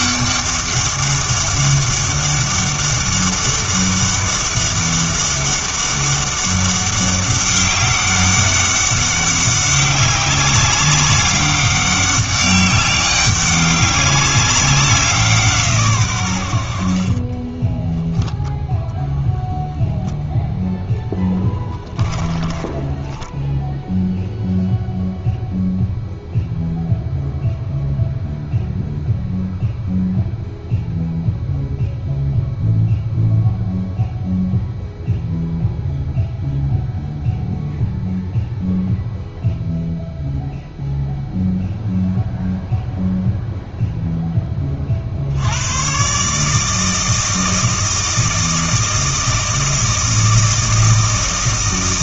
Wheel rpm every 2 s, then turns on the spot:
200, 200, 200, 200, 200, 200, 200, 190, 60, 0, 0, 10, 0, 0, 0, 0, 0, 0, 0, 0, 0, 0, 30, 150, 160, 160.
22-24